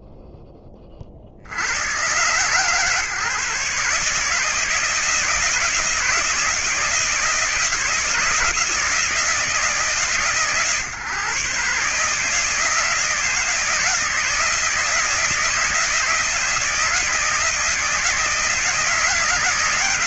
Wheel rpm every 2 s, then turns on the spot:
0, 130, 150, 160, 160, 130, 160, 160, 160, 160.
none